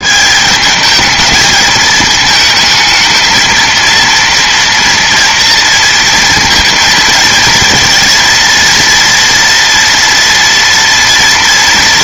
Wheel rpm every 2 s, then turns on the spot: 210, 220, 230, 230, 240, 230.
none